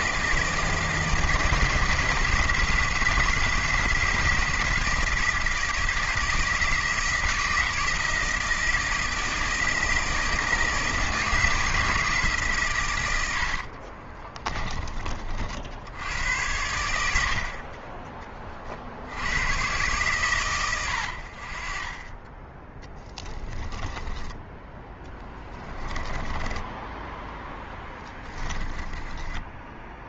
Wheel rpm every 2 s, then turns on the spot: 160, 160, 170, 160, 160, 160, 130, 30, 90, 40, 110, 20, 10, 10, 10.
14-16 26-30